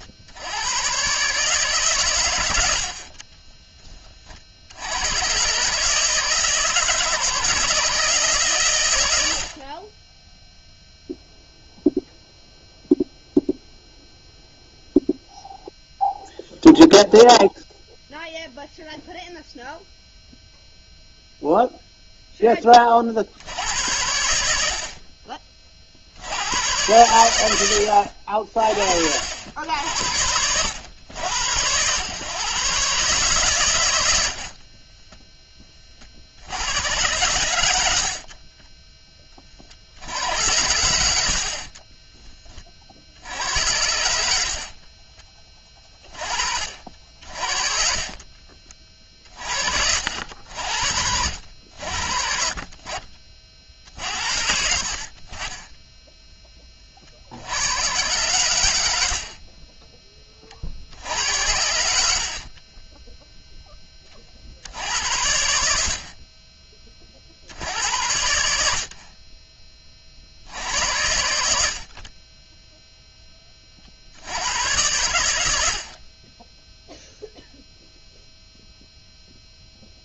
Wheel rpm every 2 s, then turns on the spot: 120, 50, 100, 160, 100, 0, 0, 0, 0, 0, 0, 50, 40, 100, 60, 100, 130, 20, 90, 20, 70, 60, 30, 50, 40, 70, 40, 60, 50, 70, 60, 20, 80, 30, 60, 80, 0, 100, 0, 0.
2-4 34-36 40-42 44-46 62-64